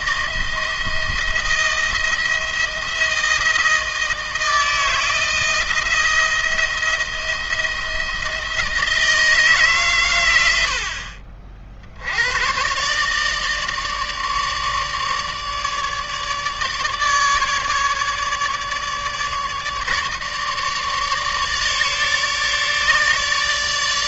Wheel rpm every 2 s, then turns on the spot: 170, 170, 160, 170, 160, 80, 120, 150, 150, 150, 150, 150.
none